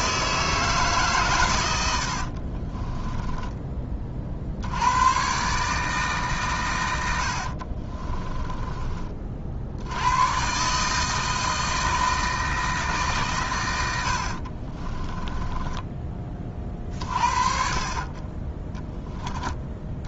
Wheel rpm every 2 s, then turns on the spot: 150, 40, 80, 110, 30, 150, 150, 30, 40, 10.
2-4 14-16